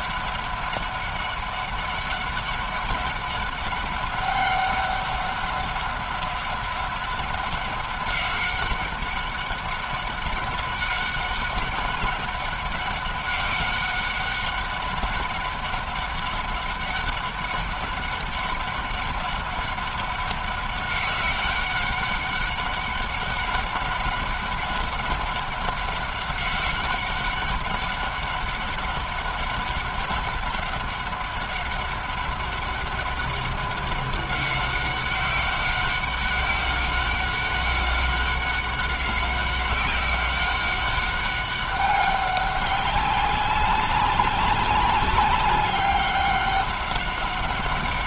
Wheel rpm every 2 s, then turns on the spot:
200, 190, 200, 190, 190, 190, 200, 200, 190, 190, 190, 200, 190, 190, 200, 200, 190, 190, 190, 190, 200, 190, 190, 190.
none